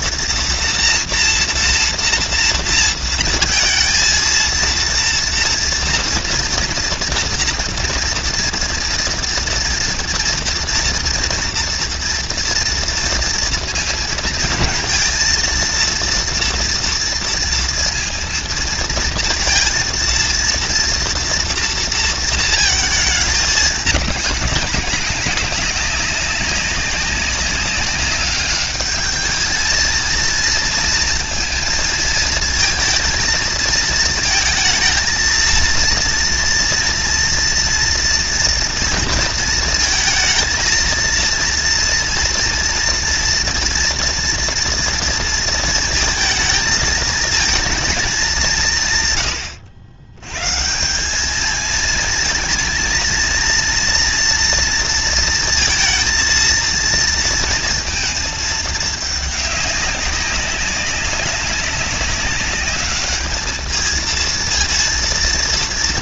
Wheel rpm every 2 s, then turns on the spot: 230, 230, 230, 230, 230, 230, 230, 230, 230, 230, 230, 220, 200, 190, 210, 230, 230, 220, 230, 230, 230, 230, 230, 220, 150, 140, 230, 230, 230, 220, 190, 200, 230.
none